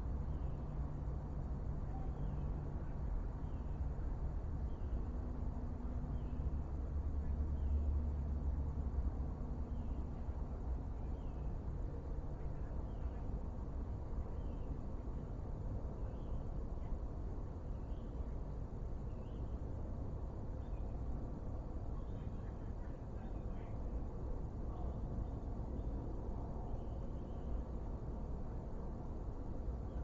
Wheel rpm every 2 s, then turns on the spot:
0, 0, 0, 0, 0, 0, 0, 0, 0, 0, 0, 0, 0, 0, 0.
none